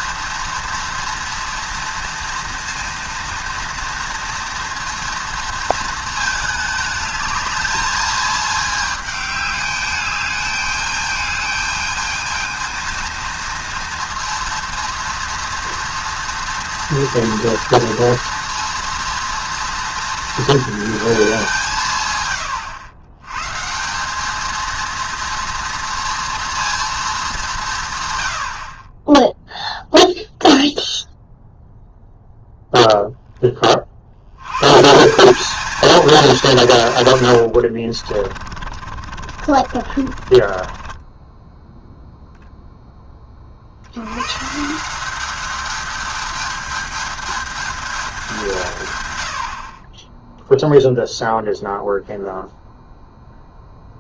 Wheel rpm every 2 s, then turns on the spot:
230, 230, 230, 210, 220, 210, 230, 230, 230, 230, 220, 100, 230, 230, 30, 0, 10, 150, 150, 50, 20, 0, 170, 210, 130, 0, 0.
38-42